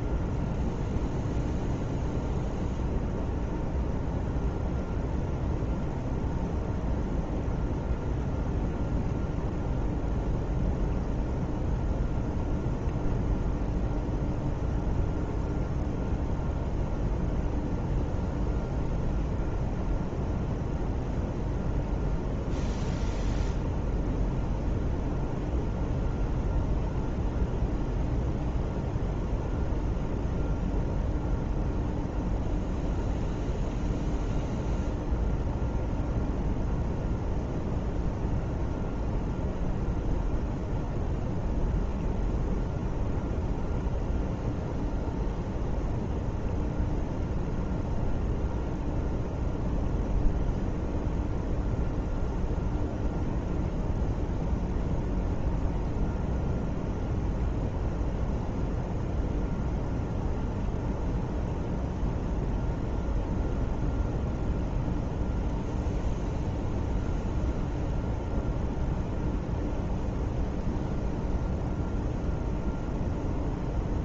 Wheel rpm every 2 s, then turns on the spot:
0, 0, 0, 0, 0, 0, 0, 0, 0, 0, 0, 0, 0, 0, 0, 0, 0, 0, 0, 0, 0, 0, 0, 0, 0, 0, 0, 0, 0, 0, 0, 0, 0, 0, 0, 0, 0.
none